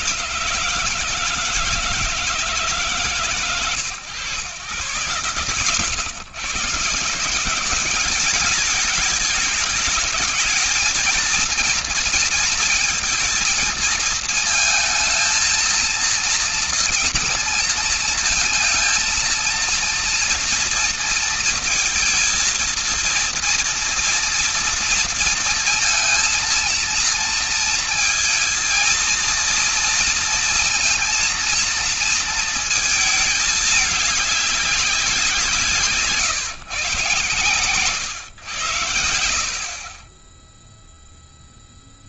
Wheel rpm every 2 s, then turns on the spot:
160, 140, 120, 140, 210, 220, 230, 230, 230, 230, 230, 230, 230, 230, 230, 230, 230, 200, 130, 110, 0.
none